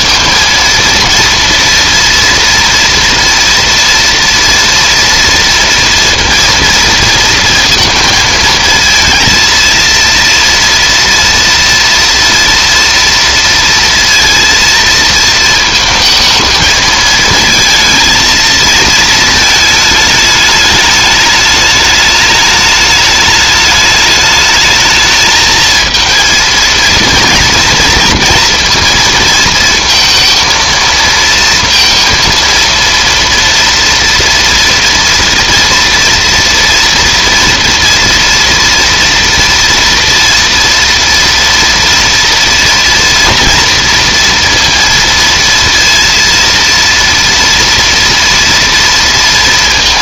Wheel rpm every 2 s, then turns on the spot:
230, 230, 230, 230, 230, 230, 230, 230, 220, 230, 210, 210, 220, 230, 230, 230, 230, 230, 230, 230, 230, 230, 230, 230, 230.
none